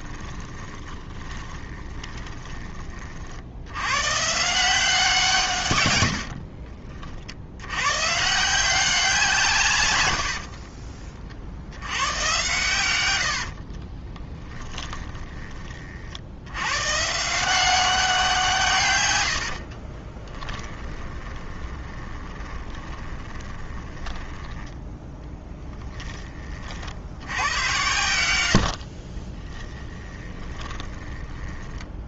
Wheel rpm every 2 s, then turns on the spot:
20, 30, 170, 50, 180, 50, 100, 20, 130, 120, 20, 20, 10, 60, 60, 10.
0-2 12-16 20-24 28-32